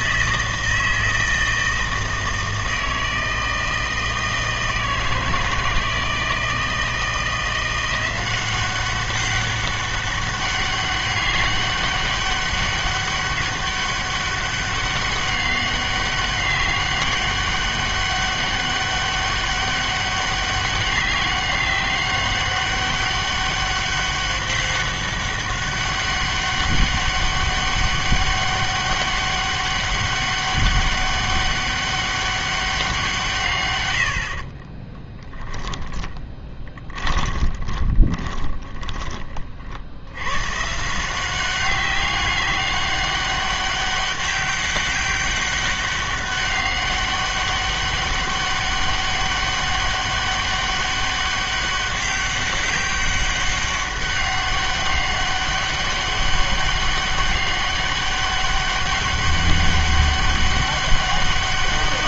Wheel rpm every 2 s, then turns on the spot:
160, 160, 160, 160, 190, 200, 200, 200, 200, 200, 200, 200, 200, 200, 200, 200, 190, 30, 20, 30, 140, 200, 190, 200, 200, 200, 200, 200, 200, 200, 200.
34-40